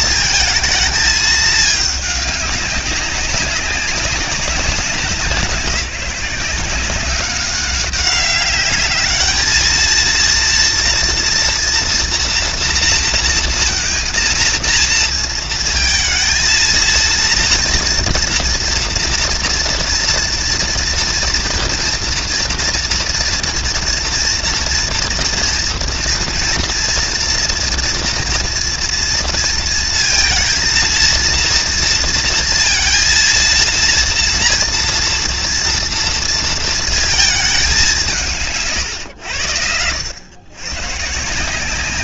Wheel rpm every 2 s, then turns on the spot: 220, 200, 190, 190, 210, 230, 230, 230, 230, 240, 230, 230, 230, 230, 230, 230, 230, 230, 230, 140, 130.
none